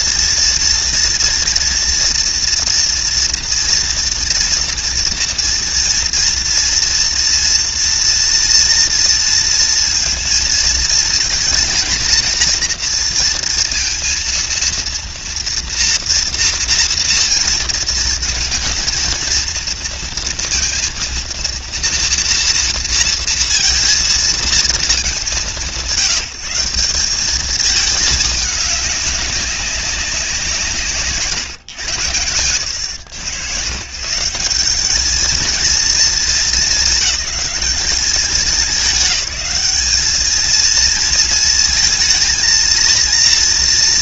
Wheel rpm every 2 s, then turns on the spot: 230, 240, 230, 240, 230, 230, 230, 230, 230, 230, 230, 230, 220, 160, 210, 170, 90, 190, 200, 200, 220, 230.
none